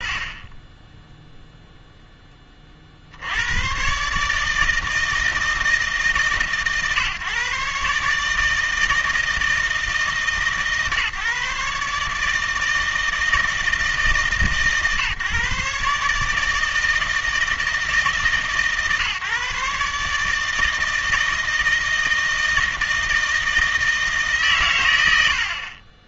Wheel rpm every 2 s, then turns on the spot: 20, 30, 160, 140, 160, 140, 160, 140, 160, 150, 160, 160, 120.
none